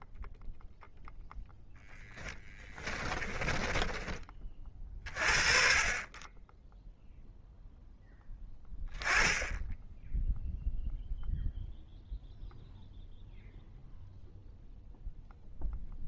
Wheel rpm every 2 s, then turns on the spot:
0, 20, 30, 0, 10, 0, 0, 0.
2-4